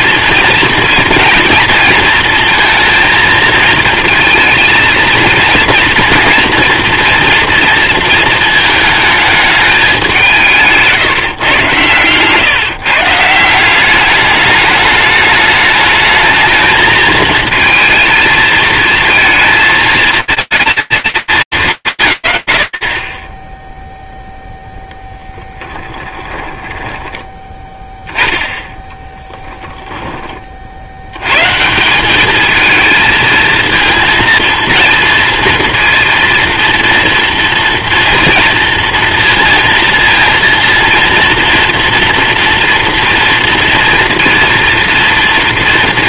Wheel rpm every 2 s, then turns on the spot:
230, 230, 230, 230, 220, 150, 150, 210, 220, 220, 220, 120, 0, 10, 10, 60, 220, 230, 230, 230, 230, 240, 230.
none